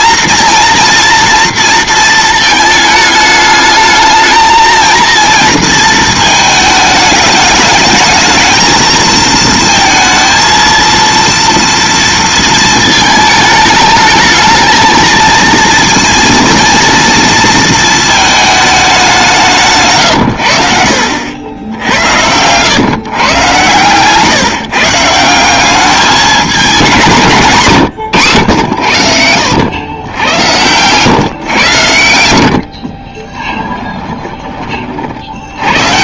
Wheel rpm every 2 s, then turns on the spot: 240, 220, 230, 220, 220, 230, 230, 220, 230, 220, 90, 110, 150, 190, 110, 110, 80, 20.
none